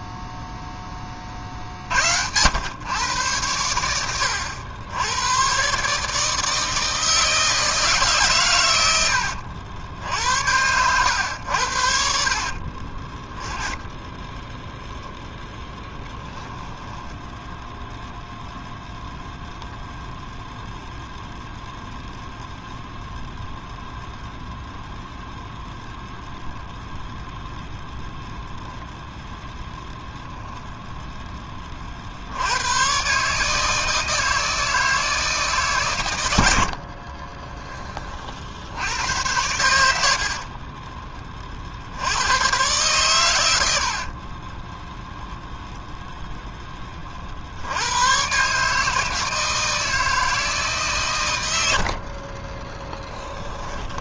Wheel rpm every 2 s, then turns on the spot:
30, 110, 100, 160, 80, 100, 20, 0, 10, 0, 0, 0, 0, 0, 0, 10, 110, 160, 60, 80, 30, 110, 20, 10, 140, 160, 20.
12-14 16-18 40-42 44-46 52-54